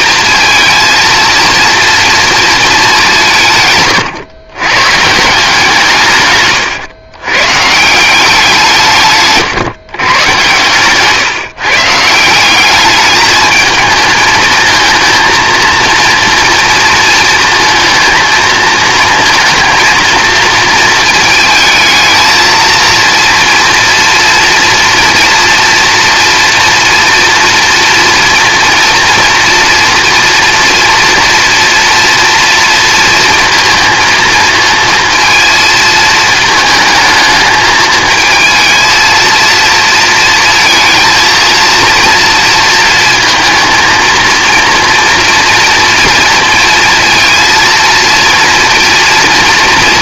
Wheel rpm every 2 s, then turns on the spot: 230, 220, 130, 120, 160, 110, 190, 220, 230, 220, 230, 230, 240, 230, 230, 230, 230, 230, 220, 230, 220, 230, 230, 230, 230.
10-12